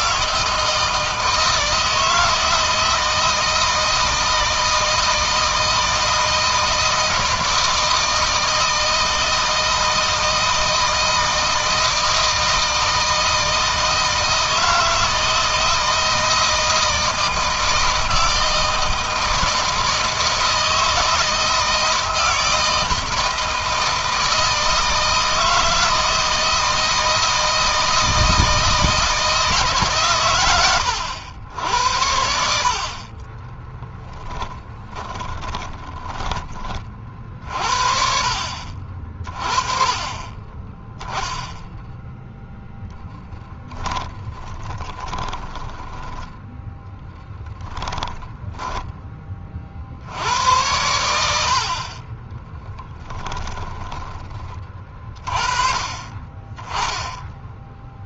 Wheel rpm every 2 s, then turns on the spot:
160, 160, 160, 160, 160, 160, 160, 160, 160, 160, 160, 160, 160, 160, 160, 100, 40, 10, 40, 40, 10, 0, 20, 10, 10, 90, 10, 30, 20.
34-36 44-46 52-54